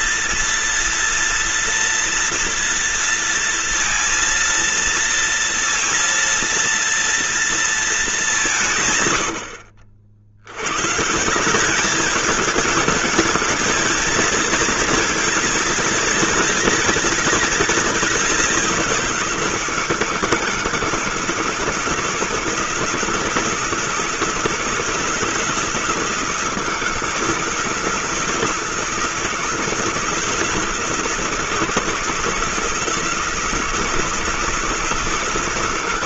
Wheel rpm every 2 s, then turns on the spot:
230, 230, 230, 230, 150, 110, 210, 230, 230, 180, 160, 160, 160, 160, 160, 160, 160, 170.
none